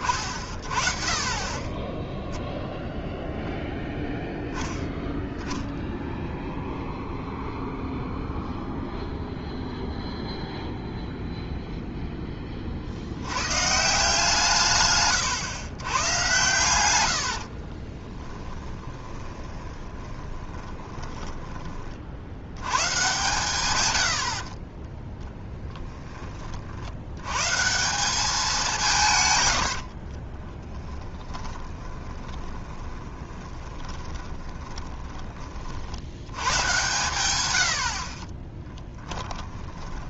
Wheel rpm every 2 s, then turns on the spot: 40, 0, 0, 0, 0, 0, 50, 140, 100, 20, 20, 120, 30, 70, 170, 10, 10, 20, 110, 20.
16-22 30-36 38-40